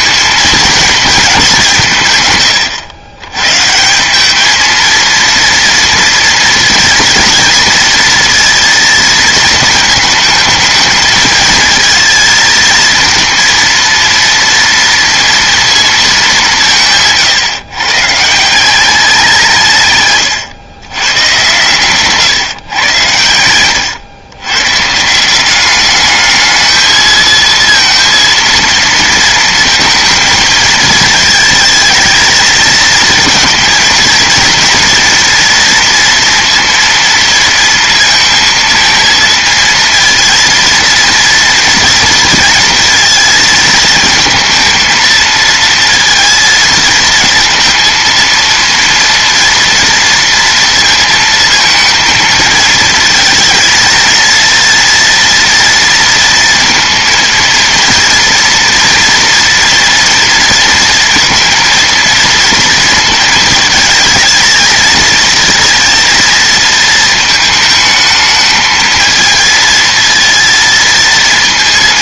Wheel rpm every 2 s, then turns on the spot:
220, 110, 230, 240, 230, 220, 230, 230, 140, 190, 120, 120, 150, 220, 230, 220, 230, 240, 230, 230, 230, 230, 230, 230, 230, 230, 220, 230, 230, 230, 230, 230, 230, 220, 220, 230.
none